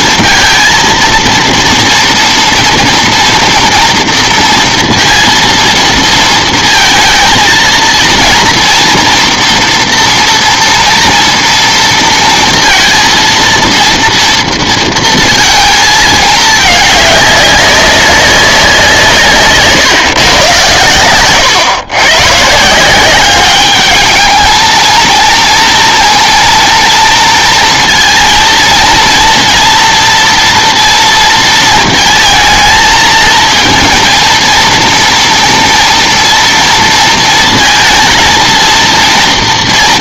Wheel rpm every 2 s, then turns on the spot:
230, 230, 230, 230, 230, 230, 230, 230, 210, 190, 120, 150, 220, 230, 230, 240, 220, 230, 230, 230.
none